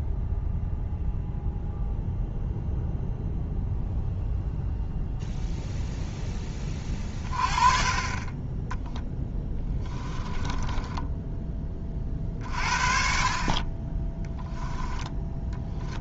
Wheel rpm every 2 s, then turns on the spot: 0, 0, 0, 20, 10, 10, 40, 10.
10-12 14-16